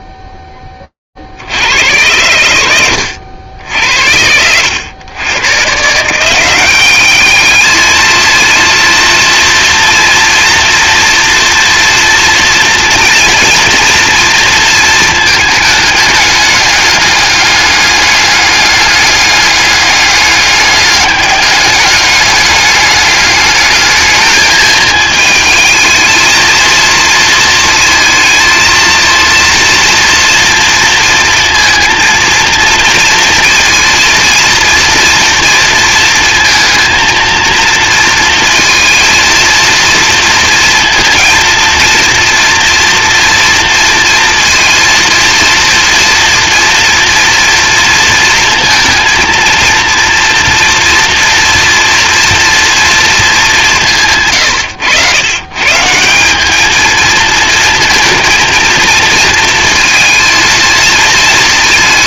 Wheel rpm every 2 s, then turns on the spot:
0, 90, 80, 170, 220, 240, 240, 240, 210, 200, 200, 200, 210, 220, 220, 230, 230, 230, 230, 230, 230, 230, 230, 230, 230, 230, 230, 170, 160, 220, 220.
none